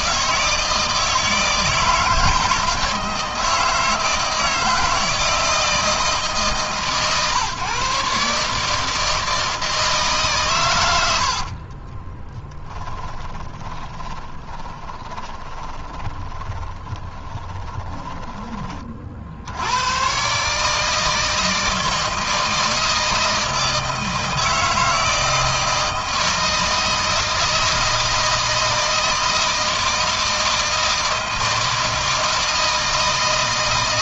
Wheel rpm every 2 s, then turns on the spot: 160, 160, 160, 140, 150, 90, 10, 20, 20, 40, 150, 160, 160, 160, 160, 160, 160.
10-18